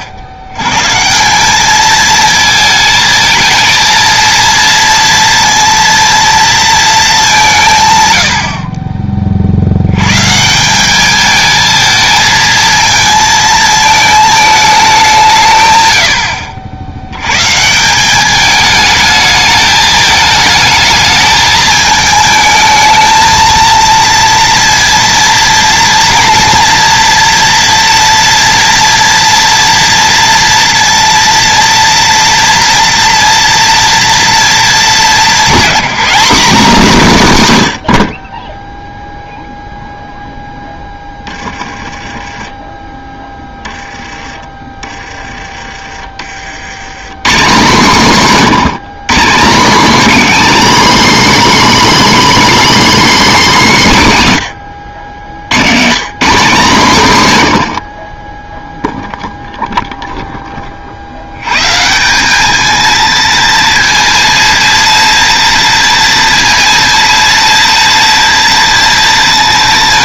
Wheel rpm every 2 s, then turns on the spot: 100, 220, 230, 230, 40, 170, 220, 210, 70, 210, 220, 220, 230, 230, 230, 230, 240, 220, 220, 10, 10, 20, 20, 90, 180, 280, 300, 90, 200, 0, 30, 220, 230, 230, 230.
none